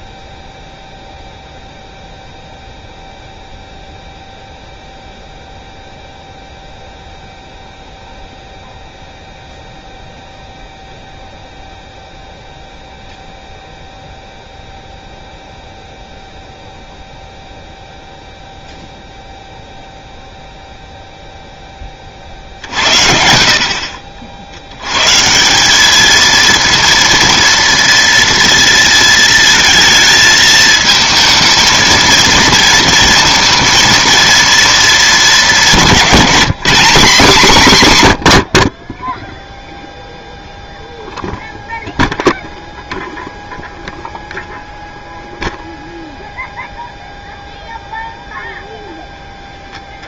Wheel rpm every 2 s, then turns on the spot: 0, 0, 0, 0, 0, 0, 0, 0, 0, 0, 0, 60, 70, 230, 230, 220, 230, 230, 210, 60, 0, 0, 0, 0, 0.
none